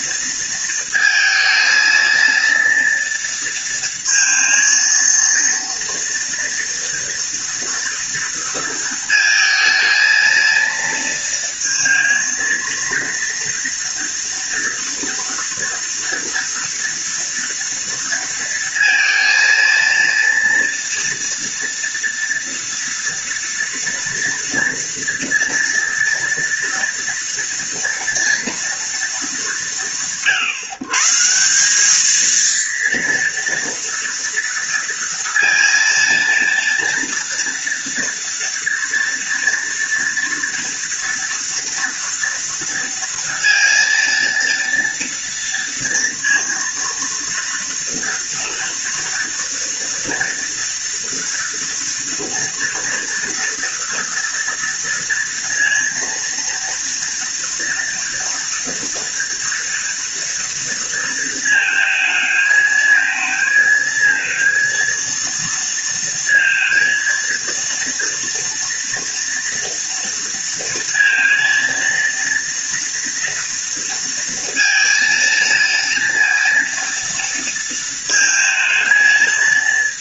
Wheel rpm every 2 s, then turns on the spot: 230, 230, 230, 230, 230, 230, 230, 230, 230, 230, 230, 230, 230, 230, 230, 140, 230, 230, 230, 240, 230, 230, 230, 230, 230, 230, 230, 230, 230, 230, 230, 220, 230, 230, 230, 230, 230, 230, 230, 220.
none